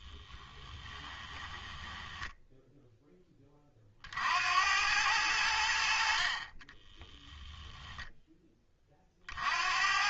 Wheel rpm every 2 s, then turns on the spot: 10, 10, 90, 10, 30.
0-2 6-8